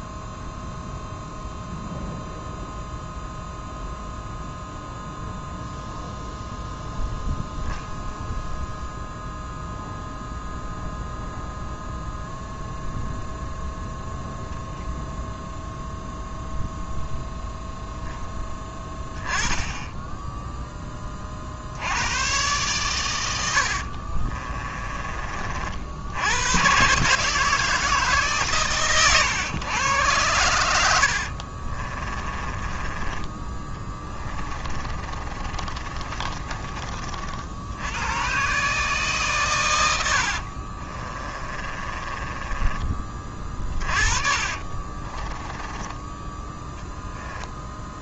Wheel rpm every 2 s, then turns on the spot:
0, 0, 0, 0, 0, 0, 0, 0, 0, 10, 10, 120, 30, 120, 120, 90, 20, 30, 40, 140, 40, 20, 30, 10.
24-26 32-36 40-42 44-46